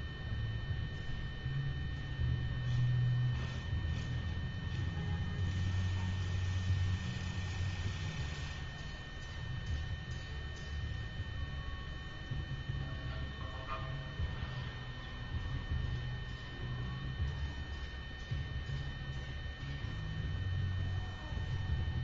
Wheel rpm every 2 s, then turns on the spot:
0, 0, 0, 0, 0, 0, 0, 0, 0, 0, 0.
none